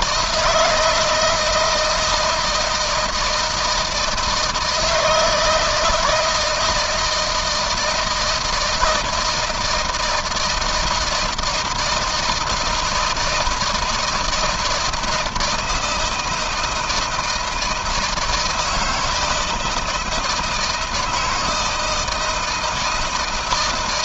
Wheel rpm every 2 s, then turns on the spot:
160, 160, 160, 160, 160, 160, 160, 160, 170, 170, 160, 160.
none